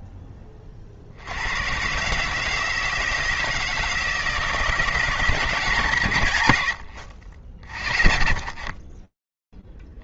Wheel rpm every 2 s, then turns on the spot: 30, 160, 160, 80, 50.
none